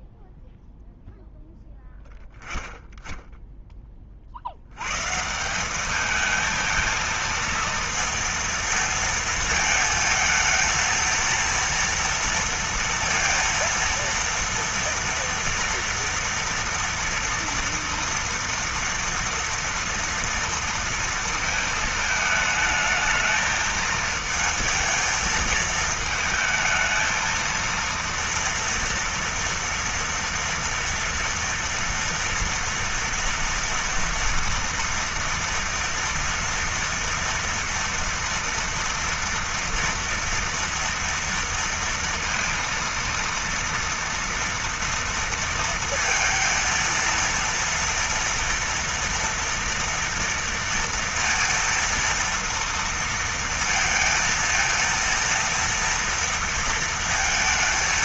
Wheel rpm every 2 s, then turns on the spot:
0, 0, 70, 220, 230, 220, 230, 230, 230, 230, 230, 220, 220, 220, 230, 230, 230, 230, 230, 230, 230, 230, 230, 230, 230, 230, 230, 230, 230.
none